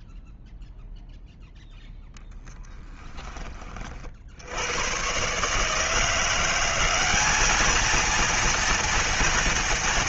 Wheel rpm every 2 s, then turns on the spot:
0, 20, 80, 180, 230.
none